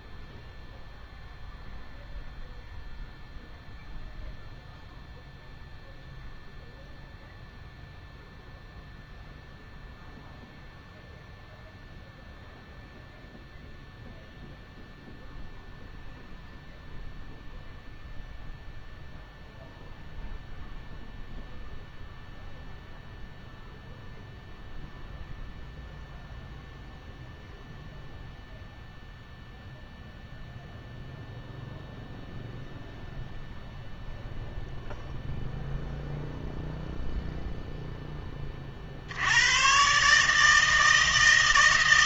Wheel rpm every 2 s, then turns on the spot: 0, 0, 0, 0, 0, 0, 0, 0, 0, 0, 0, 0, 0, 0, 0, 0, 0, 0, 0, 40, 160.
none